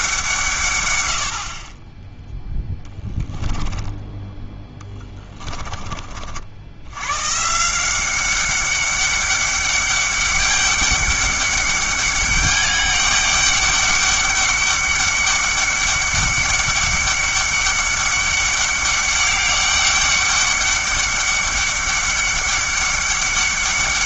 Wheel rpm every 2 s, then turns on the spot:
140, 10, 20, 80, 200, 200, 200, 200, 200, 200, 200, 200.
2-6